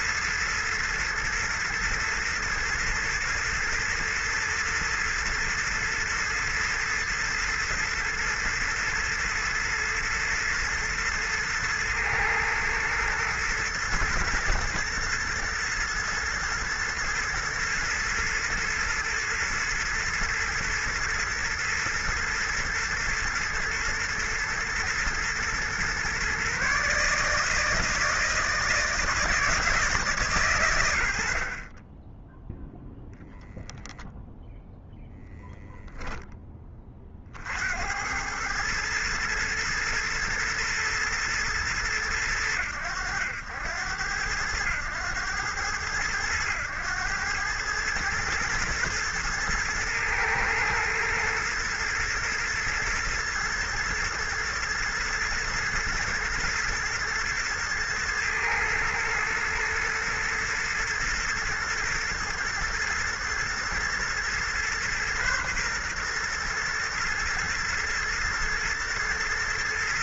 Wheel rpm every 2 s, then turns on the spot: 120, 120, 120, 110, 120, 120, 120, 120, 120, 110, 110, 120, 120, 150, 160, 70, 0, 10, 40, 110, 120, 90, 100, 100, 110, 110, 120, 120, 110, 110, 110, 120, 120, 120, 120.
none